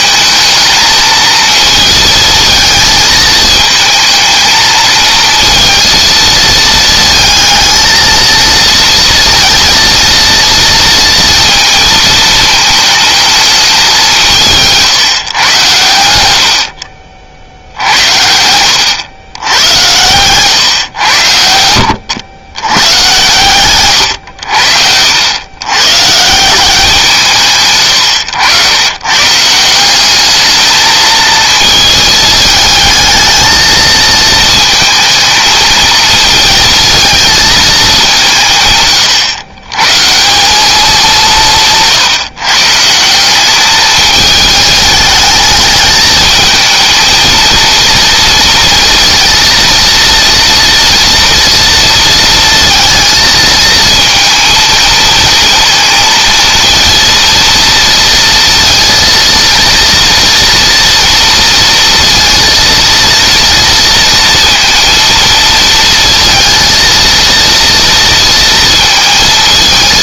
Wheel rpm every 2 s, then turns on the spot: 220, 220, 230, 220, 230, 230, 220, 150, 60, 110, 110, 110, 90, 160, 130, 220, 220, 230, 220, 130, 180, 180, 210, 230, 230, 230, 230, 230, 230, 230, 230, 230, 230, 230, 230.
none